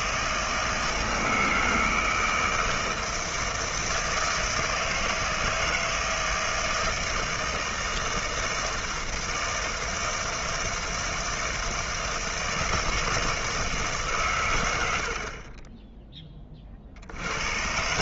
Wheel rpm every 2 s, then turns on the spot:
160, 160, 160, 160, 160, 160, 160, 100, 30.
none